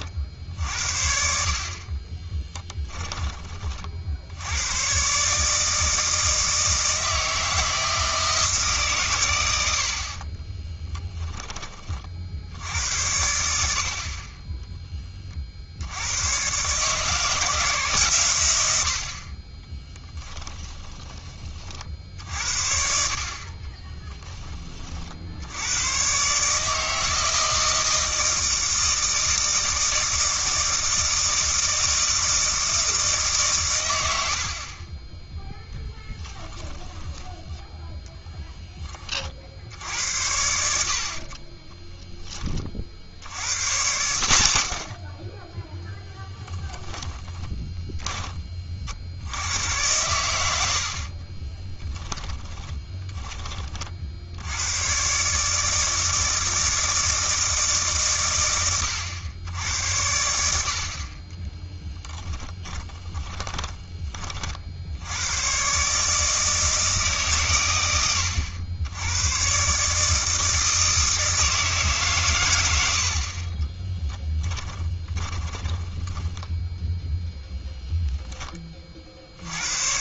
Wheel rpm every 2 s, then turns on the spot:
60, 10, 110, 160, 140, 10, 80, 20, 150, 80, 30, 60, 30, 150, 160, 160, 160, 40, 10, 20, 60, 40, 70, 10, 40, 70, 10, 100, 160, 100, 50, 10, 60, 150, 90, 160, 90, 10, 0, 30.
2-4 10-12 20-22 36-38 46-48 52-54 62-64 74-76